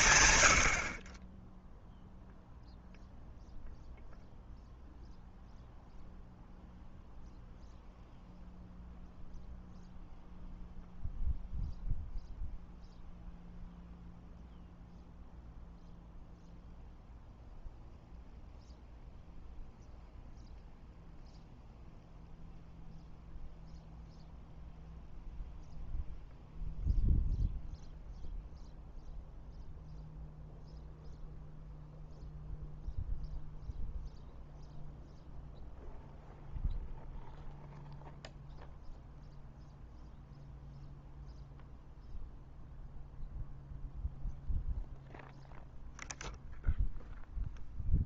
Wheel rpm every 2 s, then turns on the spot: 60, 0, 0, 0, 0, 0, 0, 0, 0, 0, 0, 0, 0, 0, 0, 0, 0, 0, 0, 0, 0, 0, 0, 0.
none